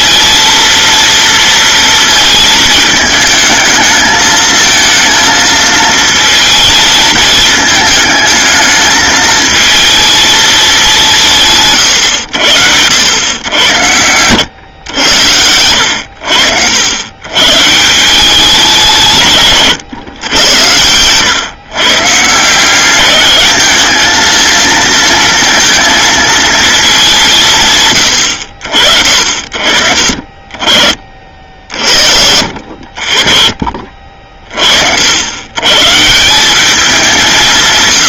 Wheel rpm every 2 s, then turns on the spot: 230, 220, 220, 230, 220, 210, 90, 110, 80, 180, 100, 180, 230, 220, 60, 30, 50, 70, 200.
32-34